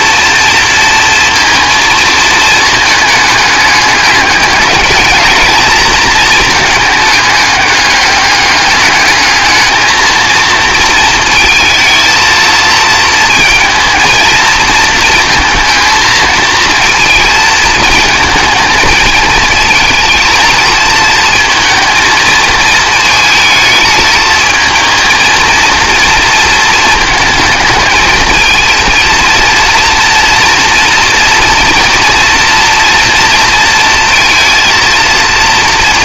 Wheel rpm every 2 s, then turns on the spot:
230, 220, 210, 220, 210, 220, 230, 230, 220, 220, 230, 220, 220, 220, 220, 230, 240, 230.
none